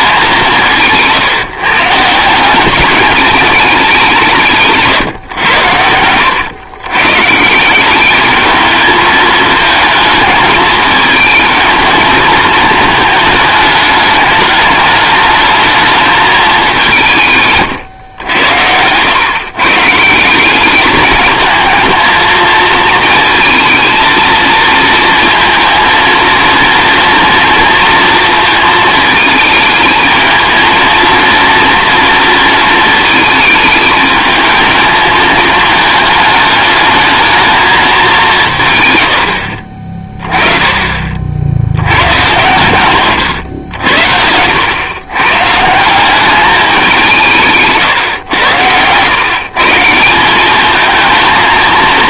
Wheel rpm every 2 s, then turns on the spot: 160, 200, 150, 120, 220, 220, 220, 210, 190, 90, 200, 230, 230, 230, 220, 230, 220, 220, 210, 130, 30, 120, 110, 190, 110, 220.
4-6